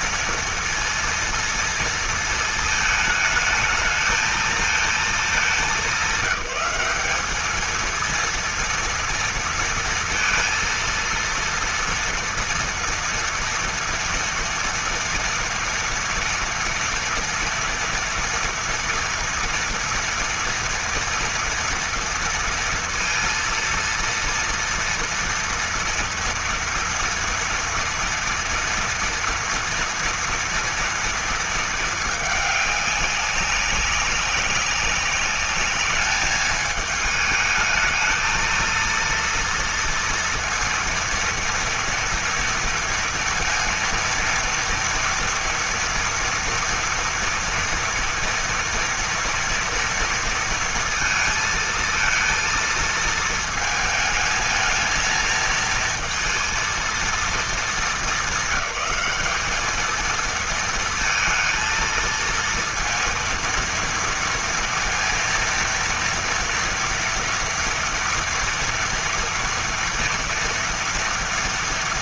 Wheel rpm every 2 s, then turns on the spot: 230, 220, 220, 200, 230, 230, 230, 230, 230, 230, 240, 230, 230, 230, 230, 230, 210, 190, 210, 230, 230, 230, 230, 230, 230, 230, 230, 220, 230, 220, 230, 230, 230, 230, 240, 230.
none